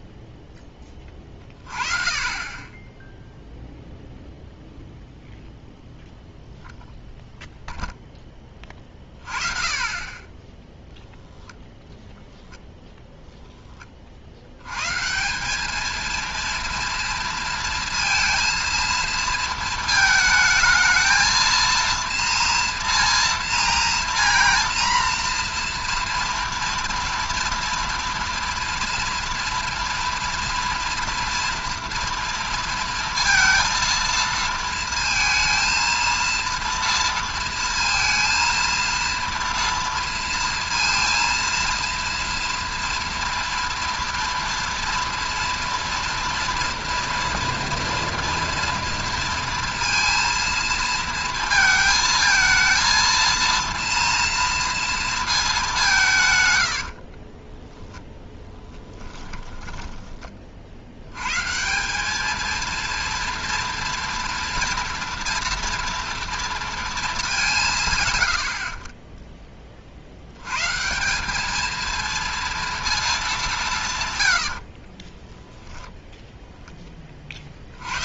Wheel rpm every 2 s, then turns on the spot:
10, 20, 0, 0, 20, 10, 10, 100, 230, 230, 220, 230, 240, 230, 230, 230, 230, 230, 230, 230, 230, 230, 230, 240, 230, 230, 220, 230, 100, 10, 50, 220, 230, 230, 60, 120, 230, 80, 0.
58-60 74-76